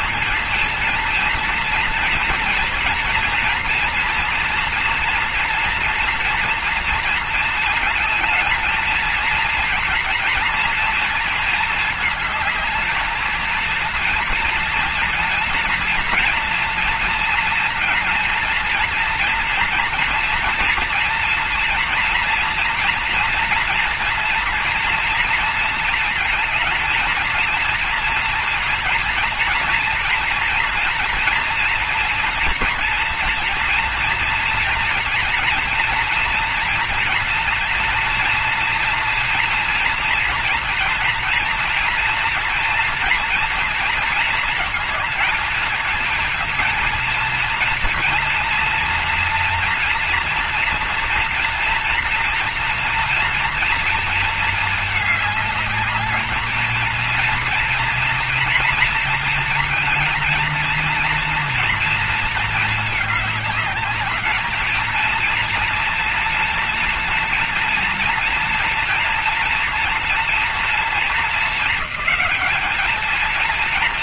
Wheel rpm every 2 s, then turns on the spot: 230, 230, 240, 230, 230, 230, 220, 230, 230, 230, 240, 240, 240, 220, 230, 240, 240, 230, 230, 230, 230, 230, 230, 230, 230, 240, 230, 220, 220, 230, 230, 220, 210, 230, 230, 230, 210.
none